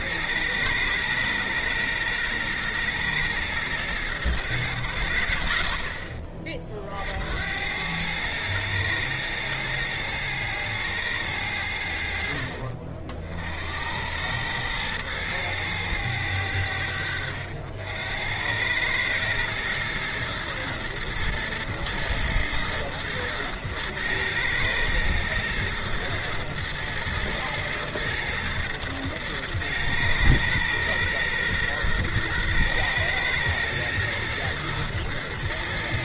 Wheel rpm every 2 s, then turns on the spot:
120, 120, 90, 30, 110, 110, 60, 100, 90, 100, 110, 110, 110, 120, 110, 120, 120, 110.
none